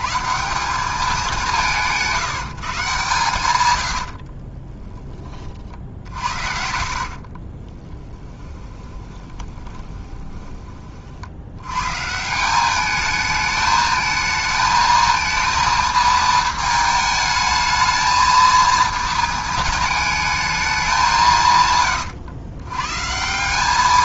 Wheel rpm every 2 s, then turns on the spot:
180, 160, 30, 70, 20, 30, 190, 220, 220, 230, 210, 110.
4-10